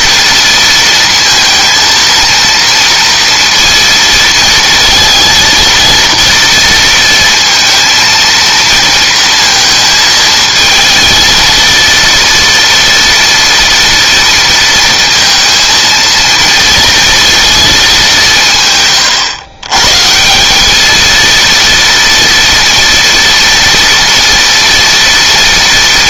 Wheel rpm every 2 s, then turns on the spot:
230, 230, 230, 230, 230, 220, 230, 230, 230, 140, 210, 230, 230.
none